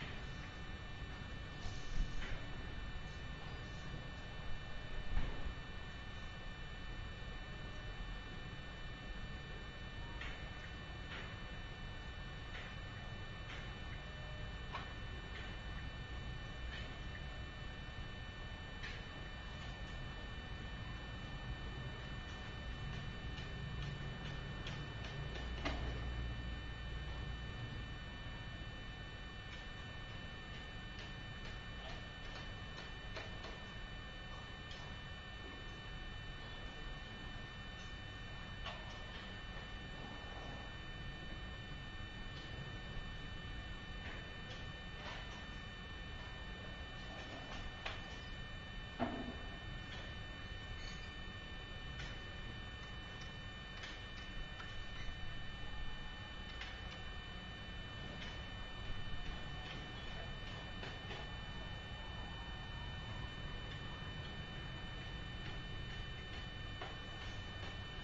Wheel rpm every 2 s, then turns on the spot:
0, 0, 0, 0, 0, 0, 0, 0, 0, 0, 0, 0, 0, 0, 0, 0, 0, 0, 0, 0, 0, 0, 0, 0, 0, 0, 0, 0, 0, 0, 0, 0, 0, 0.
none